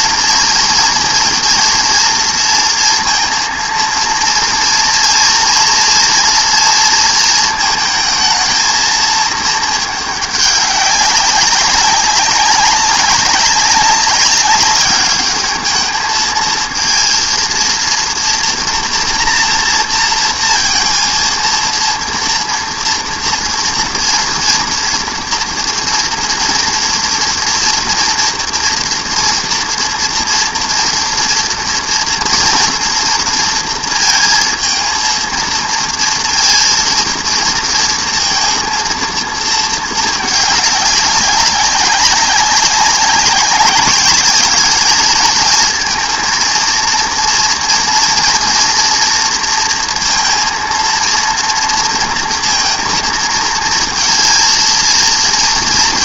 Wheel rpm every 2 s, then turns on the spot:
230, 230, 230, 230, 230, 200, 200, 200, 230, 230, 230, 230, 230, 230, 240, 240, 230, 230, 230, 230, 200, 190, 210, 230, 230, 230, 230, 230.
none